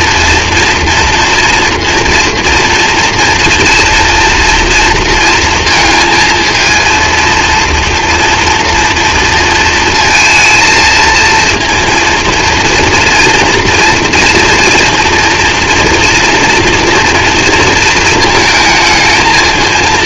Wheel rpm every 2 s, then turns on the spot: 240, 230, 240, 230, 230, 230, 230, 230, 240, 220.
none